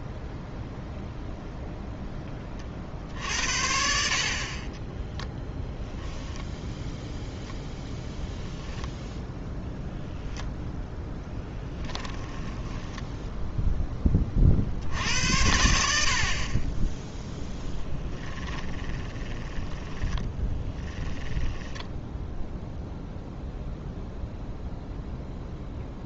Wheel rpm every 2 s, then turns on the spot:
0, 30, 40, 0, 0, 0, 10, 50, 30, 10, 10, 0, 0.
12-14 18-22